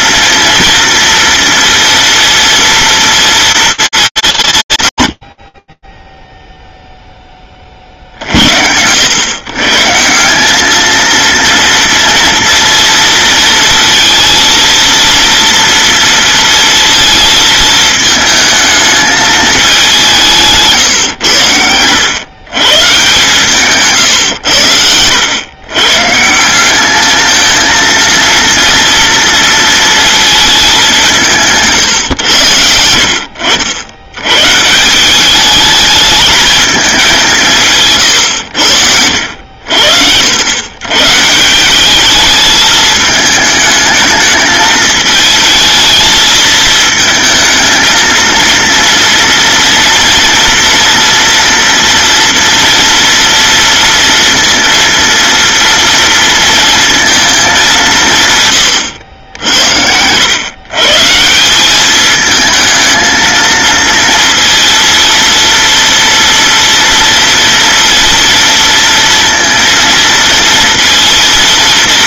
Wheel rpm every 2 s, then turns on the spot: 240, 230, 130, 0, 80, 220, 230, 230, 220, 220, 140, 140, 90, 200, 230, 210, 80, 170, 210, 80, 120, 210, 220, 220, 230, 230, 230, 230, 230, 100, 130, 220, 230, 230, 230, 230.
58-60